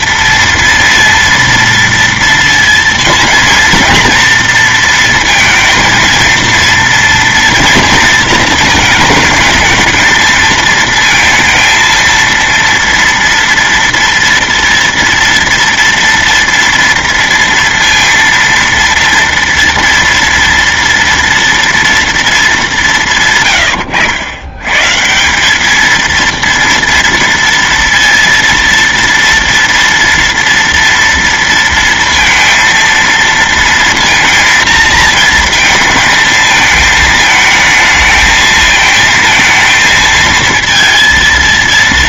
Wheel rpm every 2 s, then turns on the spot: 230, 230, 230, 230, 230, 220, 230, 230, 230, 230, 230, 210, 120, 230, 230, 230, 230, 230, 220, 220, 230.
none